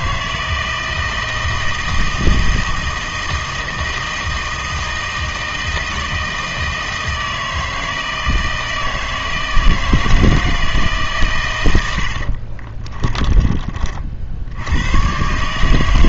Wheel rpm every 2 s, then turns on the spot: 160, 160, 160, 160, 160, 160, 30, 80.
12-14